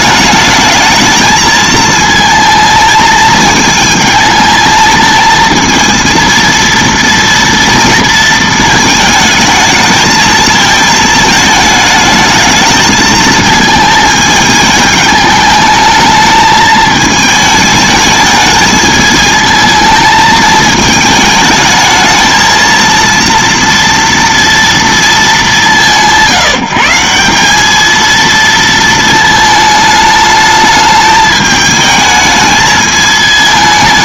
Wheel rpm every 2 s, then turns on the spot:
210, 220, 220, 230, 230, 220, 220, 210, 220, 220, 220, 230, 230, 170, 230, 210, 220.
none